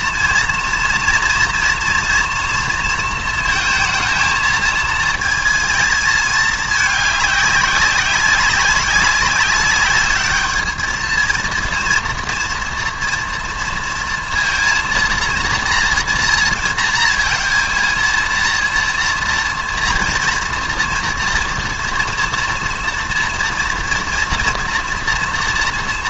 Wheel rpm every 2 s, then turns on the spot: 230, 230, 220, 210, 190, 220, 230, 230, 230, 230, 230, 230, 230.
none